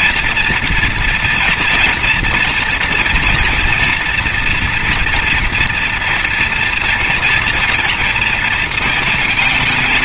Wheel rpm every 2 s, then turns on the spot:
240, 230, 240, 240, 230.
none